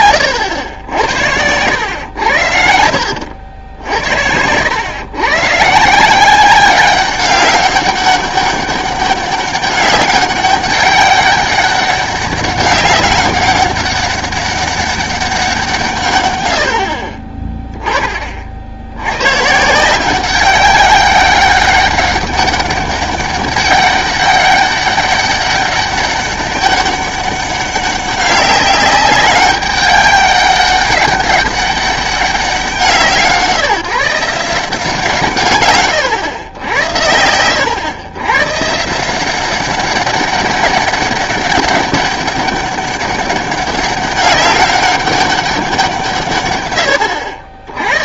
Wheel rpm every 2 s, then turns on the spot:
90, 90, 90, 190, 200, 200, 200, 200, 90, 60, 190, 200, 200, 200, 200, 200, 190, 170, 110, 140, 200, 200, 200, 120.
2-4 16-18